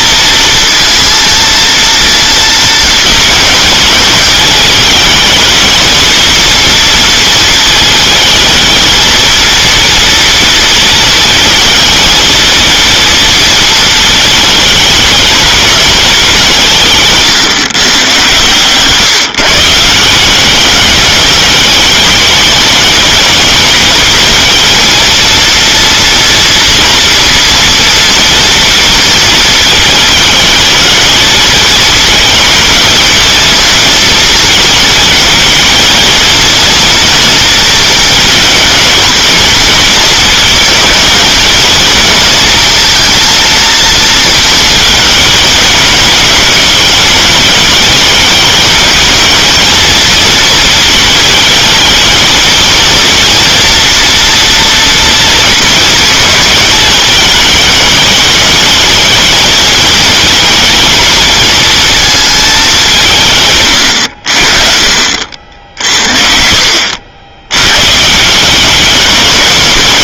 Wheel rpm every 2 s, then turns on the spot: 230, 230, 220, 230, 220, 230, 230, 220, 150, 140, 200, 210, 230, 230, 230, 220, 220, 220, 230, 230, 210, 230, 220, 210, 220, 220, 230, 230, 220, 220, 220, 190, 50, 70, 200.
none